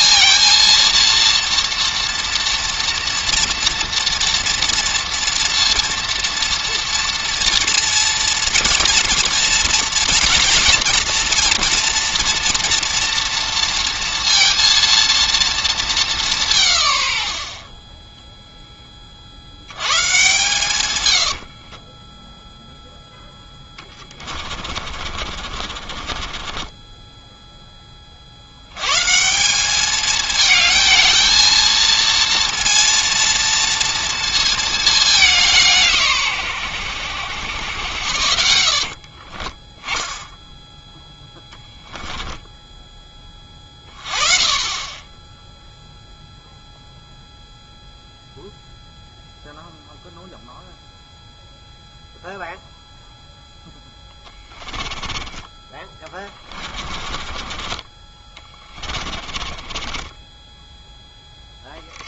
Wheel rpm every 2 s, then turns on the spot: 230, 230, 230, 230, 230, 230, 230, 230, 60, 60, 70, 0, 40, 20, 100, 220, 230, 220, 110, 60, 0, 10, 20, 0, 0, 0, 0, 20, 20, 20, 10.
20-22 24-28 38-40 42-44 54-62